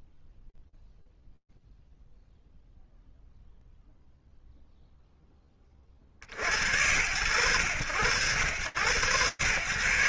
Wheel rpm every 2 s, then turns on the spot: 0, 0, 90, 100, 130.
none